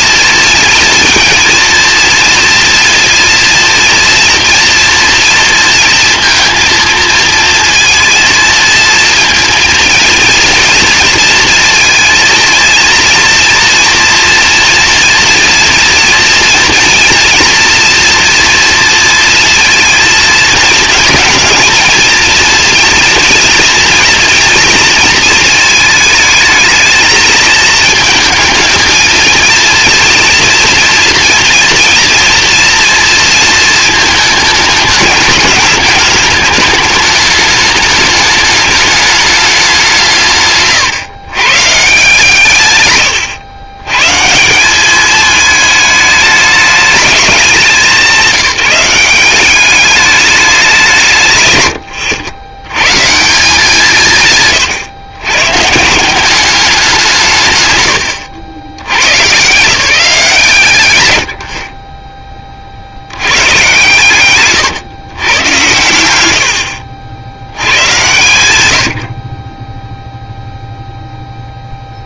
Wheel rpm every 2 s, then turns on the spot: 230, 240, 230, 230, 230, 230, 230, 240, 230, 230, 230, 230, 230, 220, 220, 230, 230, 210, 210, 210, 140, 110, 210, 200, 190, 170, 130, 120, 170, 110, 110, 50, 150, 70, 130, 0.
none